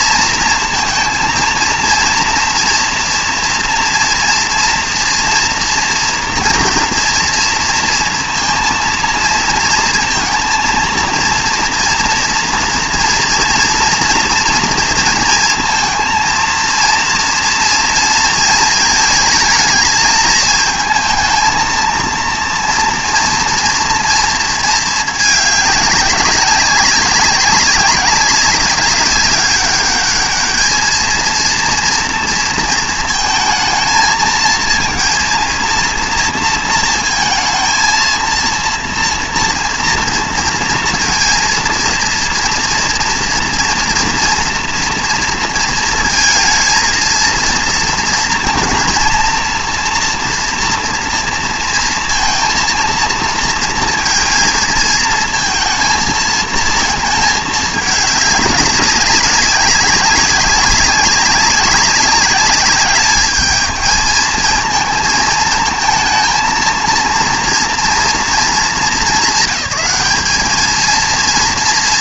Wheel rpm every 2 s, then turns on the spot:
230, 230, 230, 230, 230, 230, 230, 230, 230, 220, 220, 230, 230, 190, 190, 220, 230, 230, 230, 230, 230, 230, 230, 230, 230, 230, 230, 230, 220, 200, 200, 200, 220, 230, 220, 220.
none